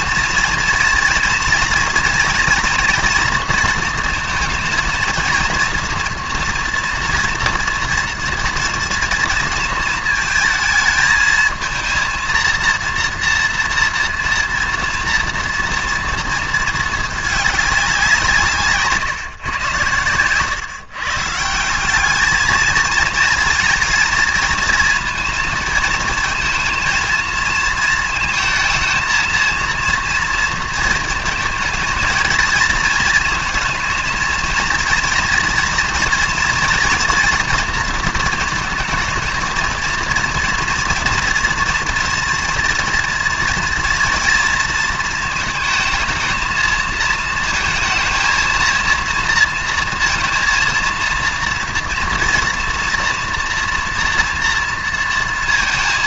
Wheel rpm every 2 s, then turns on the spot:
230, 230, 230, 230, 230, 220, 230, 230, 220, 150, 130, 220, 230, 220, 230, 230, 230, 230, 240, 220, 230, 230, 230, 220, 230, 230, 230, 230.
none